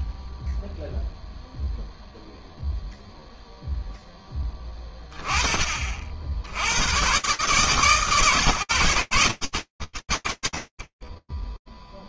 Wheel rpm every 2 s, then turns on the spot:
0, 0, 30, 120, 90, 10.
none